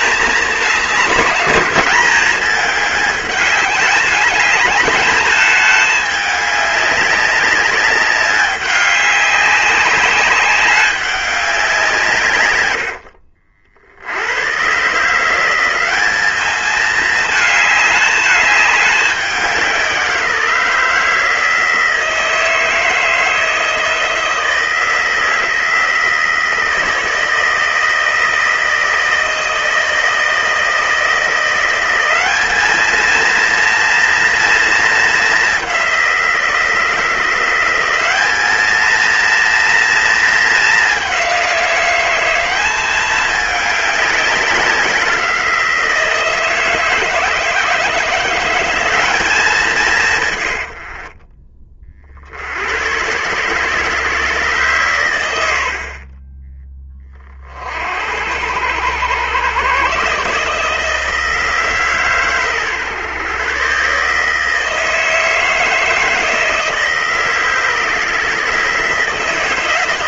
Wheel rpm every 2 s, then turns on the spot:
220, 210, 210, 200, 200, 190, 90, 130, 210, 210, 160, 160, 160, 160, 160, 160, 210, 230, 170, 220, 210, 200, 190, 160, 180, 90, 80, 140, 20, 90, 150, 130, 160, 160, 150.
none